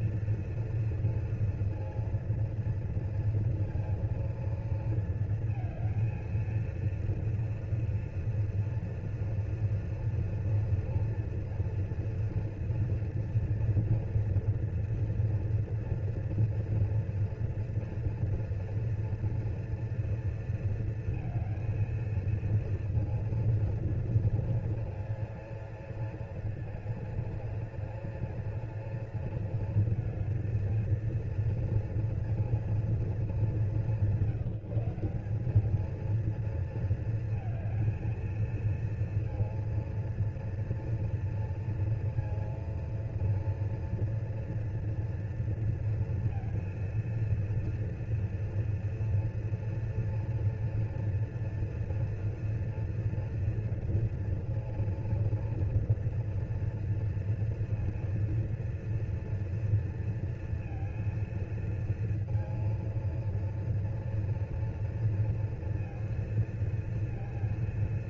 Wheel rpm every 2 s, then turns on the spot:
230, 230, 230, 230, 230, 230, 230, 230, 230, 230, 230, 230, 230, 230, 230, 230, 230, 170, 220, 230, 230, 230, 230, 230, 230, 230, 240, 230, 230, 230, 230, 230, 230, 230.
none